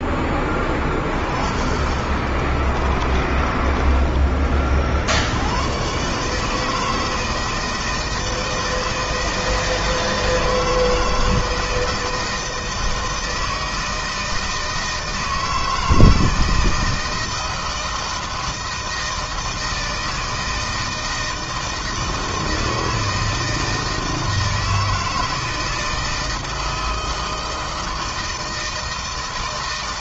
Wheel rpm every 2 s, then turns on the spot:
40, 30, 60, 160, 160, 160, 160, 160, 160, 160, 160, 160, 160, 160, 160.
2-4